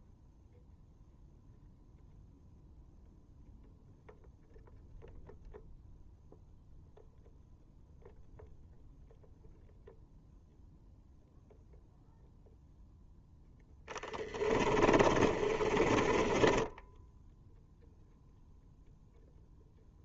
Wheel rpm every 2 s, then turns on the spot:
0, 0, 0, 0, 0, 0, 0, 20, 10, 0.
14-16